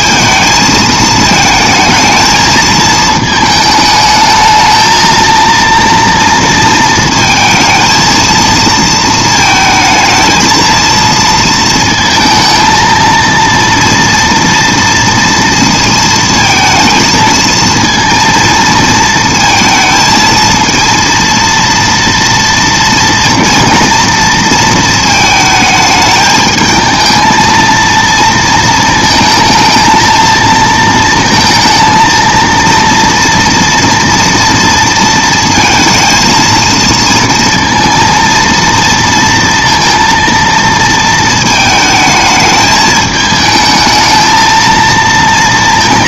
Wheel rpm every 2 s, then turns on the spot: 220, 220, 220, 230, 230, 220, 220, 230, 230, 230, 230, 230, 230, 210, 230, 230, 230, 230, 230, 230, 230, 220, 220.
none